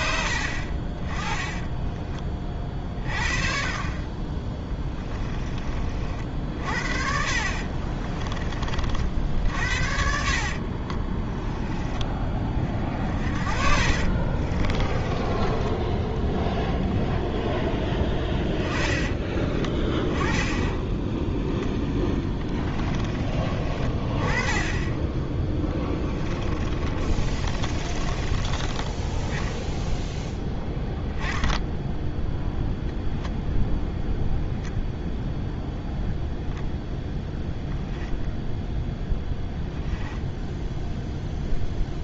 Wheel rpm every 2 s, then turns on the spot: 30, 40, 10, 50, 50, 30, 40, 30, 10, 20, 10, 20, 10, 30, 20, 0, 0, 0, 0, 0, 0.
4-6 10-16 26-28